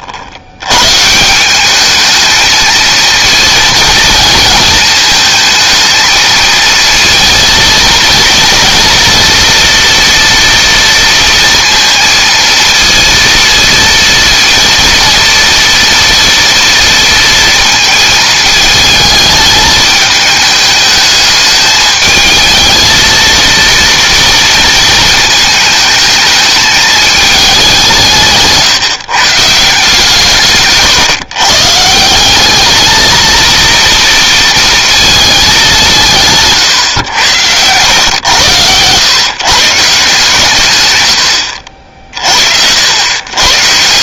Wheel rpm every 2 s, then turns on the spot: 120, 230, 230, 230, 230, 230, 230, 230, 230, 220, 210, 220, 230, 210, 150, 140, 220, 230, 130, 120, 110, 80.
none